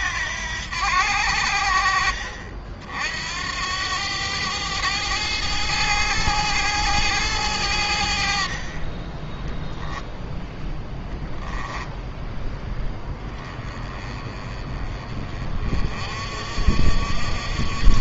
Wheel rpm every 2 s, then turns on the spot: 80, 60, 110, 110, 30, 0, 10, 30, 50.
none